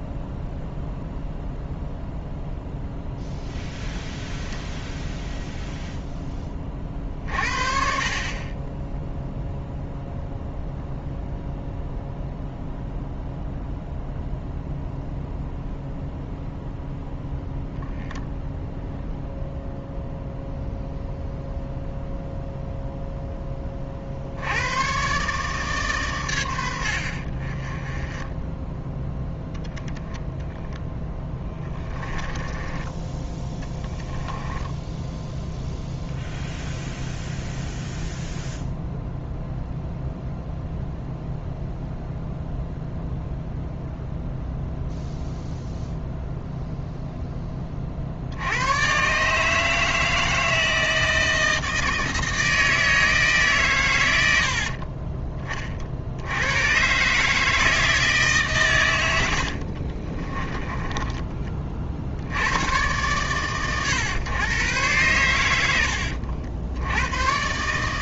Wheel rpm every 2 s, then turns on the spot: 0, 0, 0, 30, 10, 0, 0, 0, 0, 0, 0, 0, 120, 70, 10, 0, 20, 10, 0, 0, 0, 0, 0, 0, 120, 160, 160, 50, 120, 120, 20, 120, 120, 80.
32-36 54-56 60-62